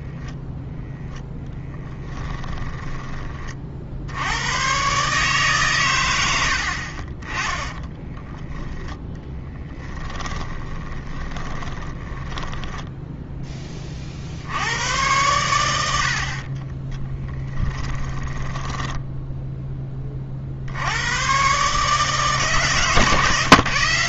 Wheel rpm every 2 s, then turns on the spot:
0, 10, 120, 50, 10, 20, 10, 90, 20, 10, 90, 150.
2-4 10-14 18-20